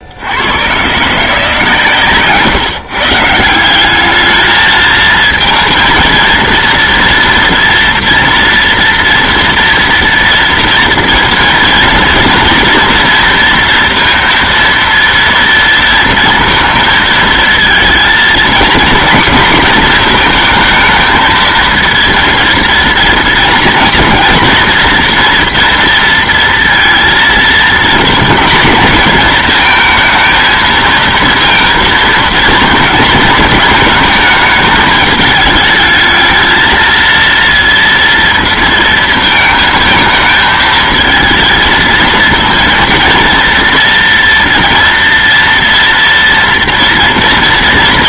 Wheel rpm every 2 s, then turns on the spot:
140, 140, 220, 230, 240, 230, 230, 230, 220, 250, 220, 230, 230, 230, 230, 230, 220, 220, 230, 230, 220, 230, 230, 230.
none